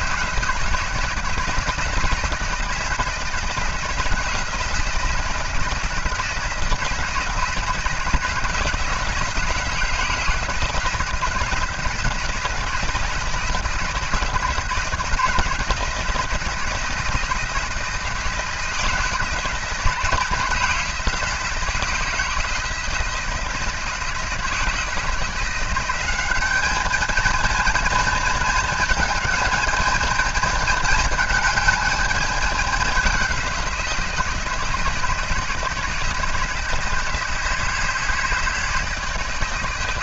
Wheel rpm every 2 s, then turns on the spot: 170, 160, 170, 170, 160, 160, 160, 160, 160, 160, 160, 160, 160, 210, 220, 220, 200, 160, 160, 160.
none